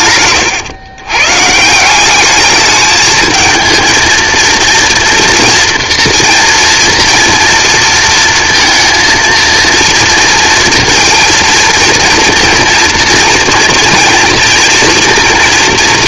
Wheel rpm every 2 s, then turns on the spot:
130, 220, 230, 240, 230, 230, 230, 230.
none